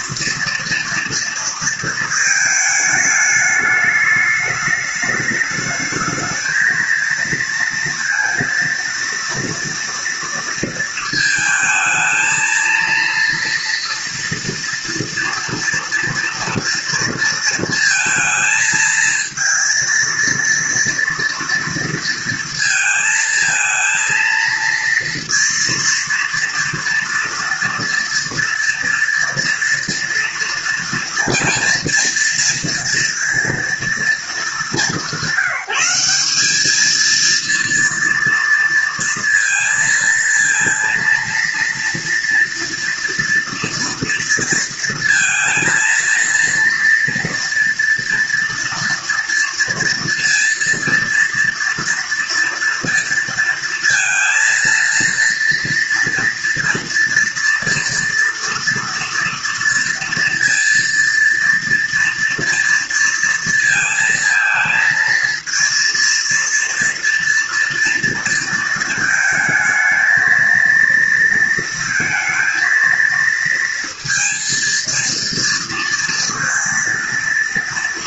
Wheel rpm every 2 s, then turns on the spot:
230, 220, 210, 220, 230, 230, 230, 230, 230, 220, 230, 230, 230, 230, 230, 230, 230, 210, 210, 230, 230, 230, 230, 230, 240, 230, 230, 230, 240, 230, 230, 230, 230, 230, 230, 230, 230, 230, 230.
none